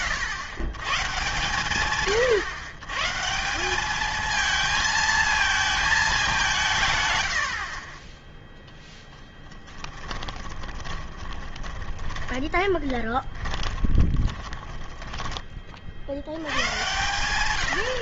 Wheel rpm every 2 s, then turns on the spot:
120, 120, 220, 170, 0, 20, 20, 30, 110.
10-16